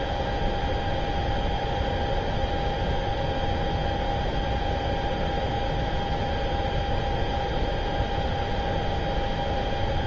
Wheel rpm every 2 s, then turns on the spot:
0, 0, 0, 0, 0.
none